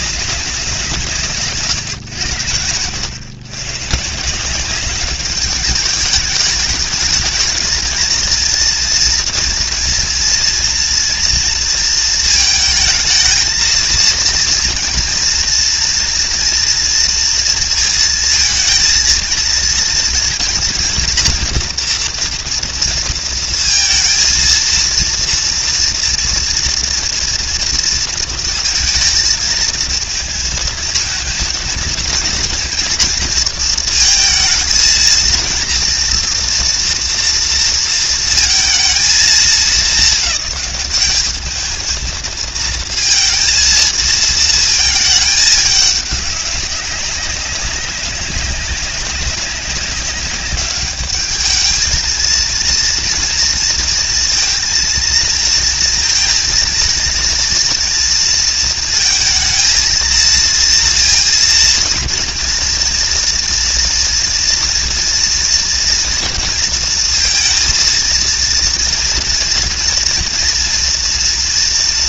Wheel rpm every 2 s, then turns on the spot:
170, 110, 190, 220, 230, 240, 220, 240, 240, 230, 240, 230, 230, 230, 220, 230, 230, 230, 230, 230, 210, 220, 220, 190, 190, 200, 230, 230, 230, 230, 230, 230, 230, 230, 230, 230.
none